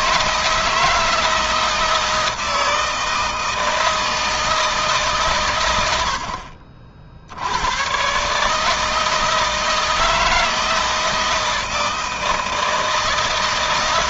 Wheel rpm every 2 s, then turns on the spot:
160, 160, 150, 60, 160, 160, 160.
none